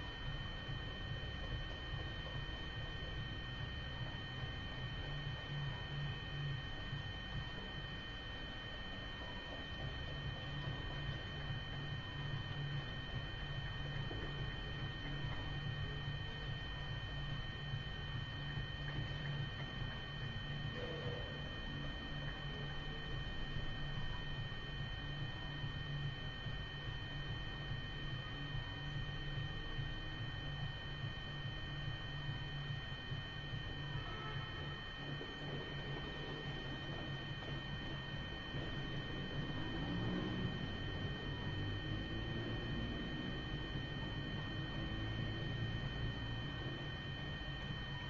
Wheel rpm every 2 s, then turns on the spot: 0, 0, 0, 0, 0, 0, 0, 0, 0, 0, 0, 0, 0, 0, 0, 0, 0, 0, 0, 0, 0, 0, 0, 0.
none